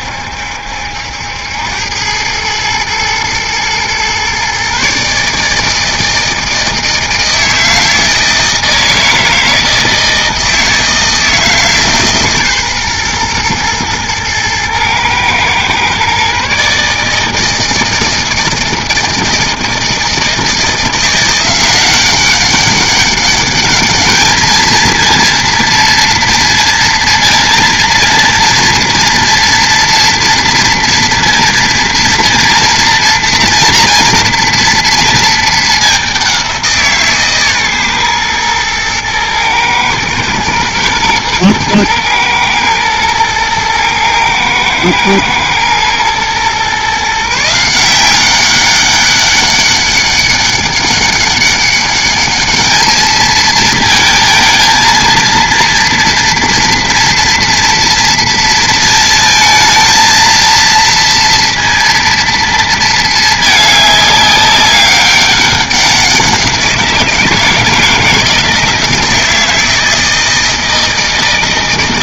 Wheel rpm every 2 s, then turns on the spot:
70, 110, 140, 160, 160, 160, 130, 120, 150, 160, 170, 200, 220, 230, 230, 230, 230, 230, 170, 120, 110, 110, 110, 130, 200, 200, 210, 220, 230, 220, 230, 230, 200, 170, 160, 160.
none